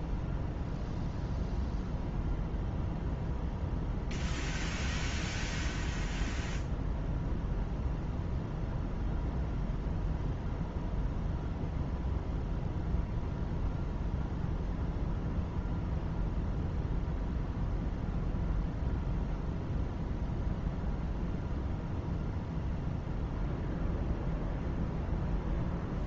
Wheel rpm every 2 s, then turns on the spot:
0, 0, 0, 0, 0, 0, 0, 0, 0, 0, 0, 0, 0.
none